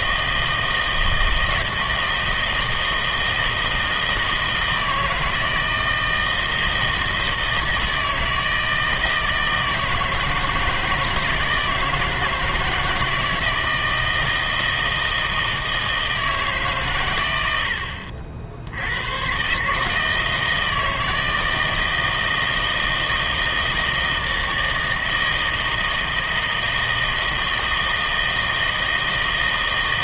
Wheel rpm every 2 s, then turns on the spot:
160, 160, 160, 160, 160, 160, 160, 160, 130, 80, 160, 160, 160, 160, 160.
none